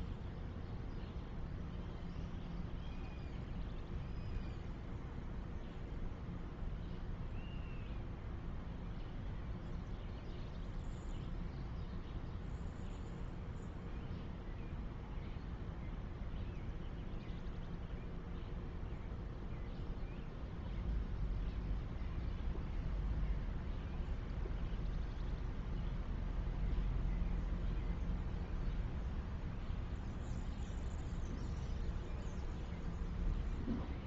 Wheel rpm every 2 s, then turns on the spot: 0, 0, 0, 0, 0, 0, 0, 0, 0, 0, 0, 0, 0, 0, 0, 0, 0.
none